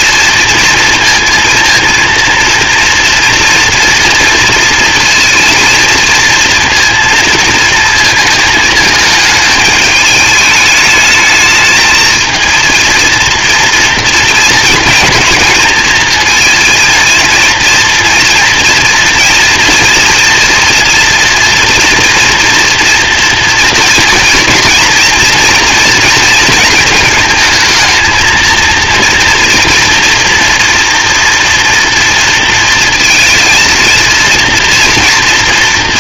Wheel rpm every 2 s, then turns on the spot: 230, 230, 230, 230, 220, 210, 230, 230, 230, 230, 230, 230, 230, 220, 230, 230, 230, 230.
none